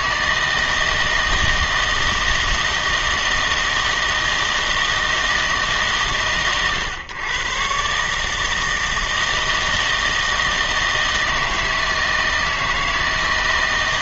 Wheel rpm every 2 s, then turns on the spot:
160, 160, 160, 120, 160, 160, 160.
none